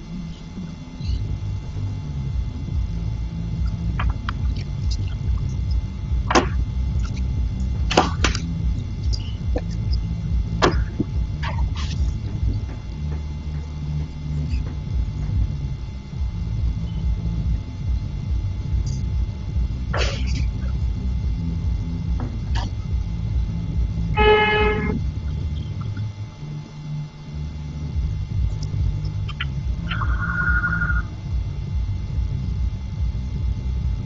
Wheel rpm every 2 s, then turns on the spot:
0, 0, 0, 0, 0, 0, 0, 0, 0, 0, 0, 0, 0, 0, 0, 0, 0.
none